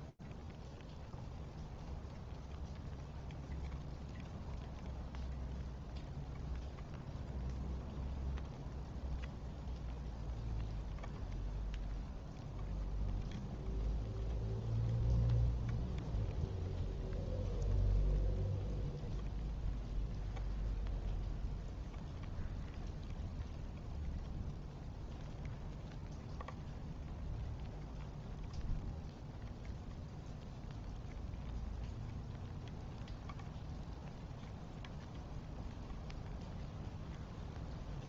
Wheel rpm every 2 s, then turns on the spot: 0, 0, 0, 0, 0, 0, 0, 0, 0, 0, 0, 0, 0, 0, 0, 0, 0, 0, 0.
none